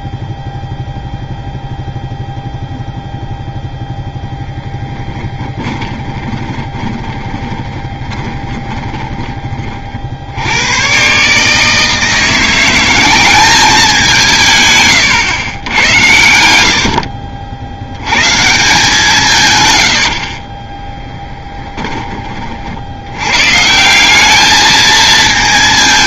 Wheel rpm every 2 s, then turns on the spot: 0, 0, 10, 20, 20, 110, 180, 140, 90, 150, 20, 70, 220.
4-10 20-22